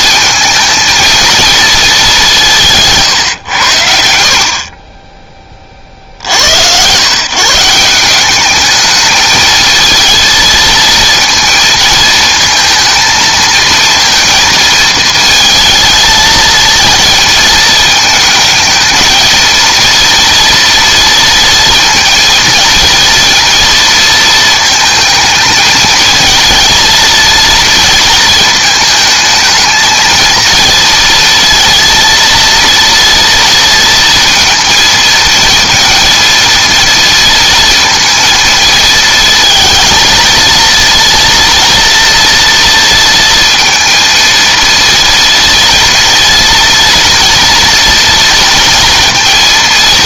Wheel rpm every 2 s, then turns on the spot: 230, 150, 40, 100, 210, 220, 220, 220, 220, 220, 230, 230, 220, 230, 220, 230, 230, 230, 230, 220, 230, 230, 230, 230, 230.
4-6